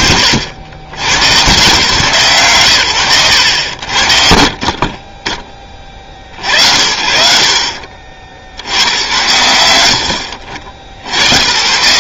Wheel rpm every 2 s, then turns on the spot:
90, 110, 40, 70, 90, 70.
none